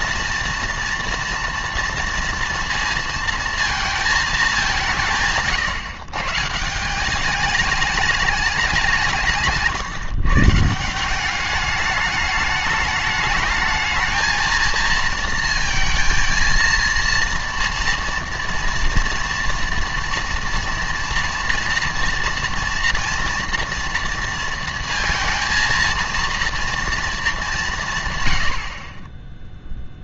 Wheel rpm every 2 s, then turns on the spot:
230, 230, 190, 160, 200, 160, 210, 220, 230, 230, 230, 230, 230, 230, 70.
none